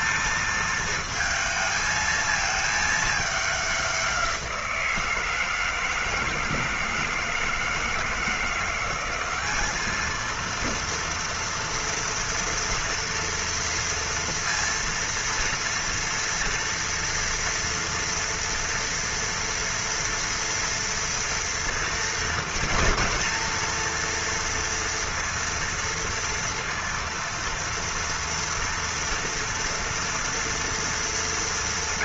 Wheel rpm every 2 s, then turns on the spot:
220, 220, 180, 160, 180, 230, 230, 230, 230, 230, 230, 230, 230, 230, 230, 230.
none